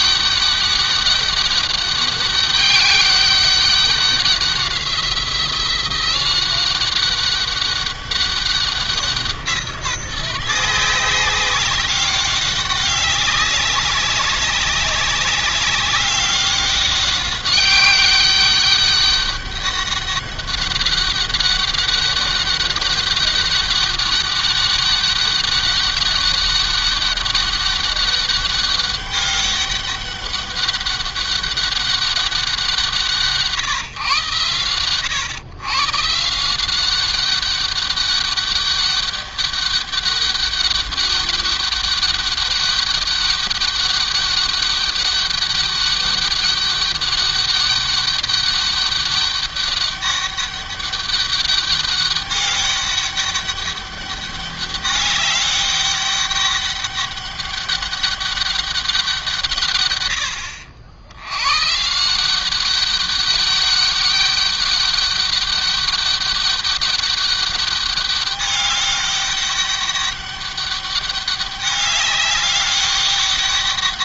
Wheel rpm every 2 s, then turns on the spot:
200, 200, 180, 200, 170, 190, 200, 200, 200, 200, 200, 200, 200, 200, 200, 190, 150, 120, 200, 200, 200, 200, 200, 200, 200, 200, 200, 200, 200, 160, 110, 200, 200, 200, 200, 200, 200.
none